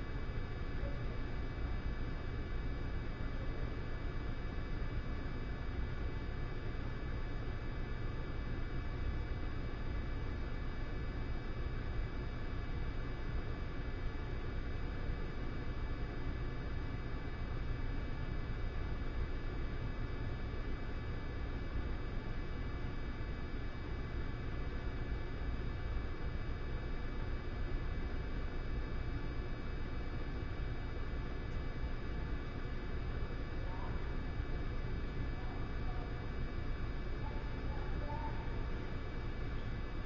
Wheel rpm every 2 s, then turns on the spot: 0, 0, 0, 0, 0, 0, 0, 0, 0, 0, 0, 0, 0, 0, 0, 0, 0, 0, 0, 0.
none